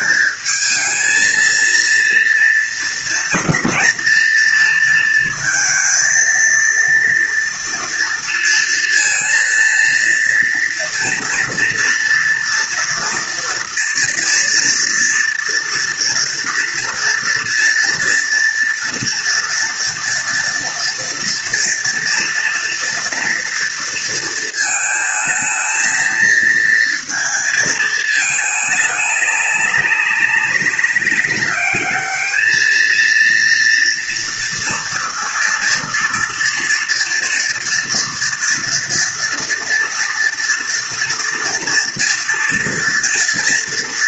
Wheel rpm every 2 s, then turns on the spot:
220, 230, 230, 230, 230, 230, 230, 230, 230, 230, 230, 240, 220, 230, 210, 200, 220, 230, 230, 230, 230, 230.
none